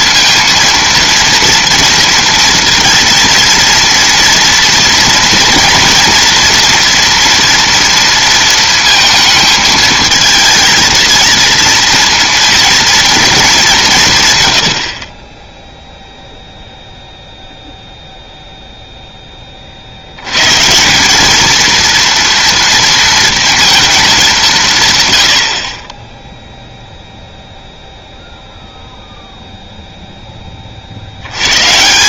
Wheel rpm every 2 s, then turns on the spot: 230, 230, 240, 240, 230, 220, 230, 100, 0, 0, 150, 230, 190, 0, 0, 30.
none